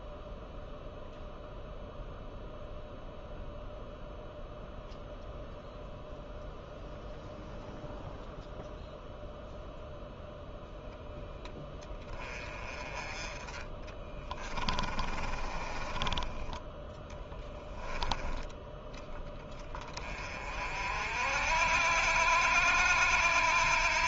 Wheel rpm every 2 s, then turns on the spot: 0, 0, 0, 0, 0, 0, 20, 30, 10, 10, 50, 80.
14-16